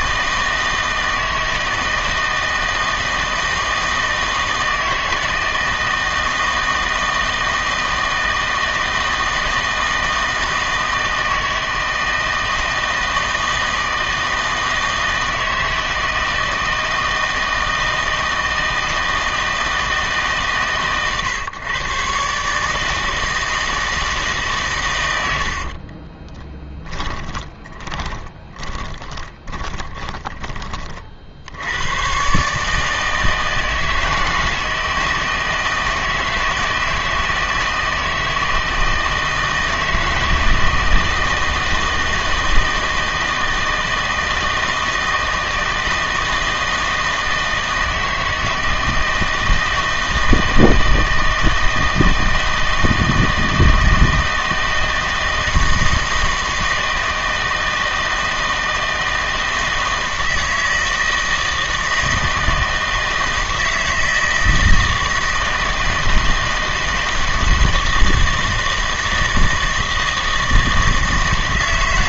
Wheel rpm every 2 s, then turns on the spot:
160, 160, 160, 160, 160, 160, 160, 160, 160, 160, 130, 150, 130, 20, 20, 40, 150, 160, 160, 160, 160, 160, 160, 160, 160, 160, 160, 160, 160, 160, 160, 160, 160, 160, 160, 160.
26-30